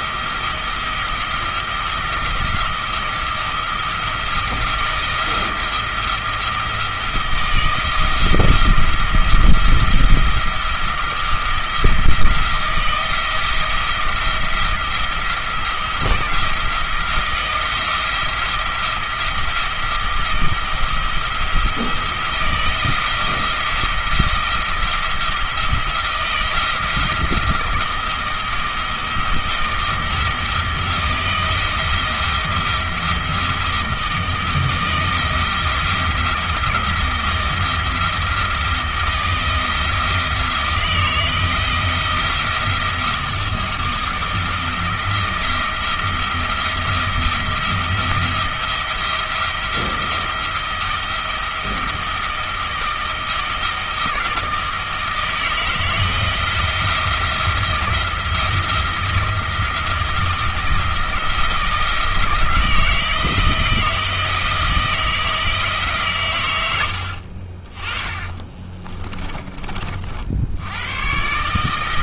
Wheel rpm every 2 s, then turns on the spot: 170, 170, 170, 160, 170, 160, 170, 170, 170, 170, 170, 160, 170, 160, 160, 170, 170, 160, 170, 160, 160, 170, 170, 170, 170, 170, 160, 160, 170, 170, 160, 160, 160, 90, 20, 100.
68-70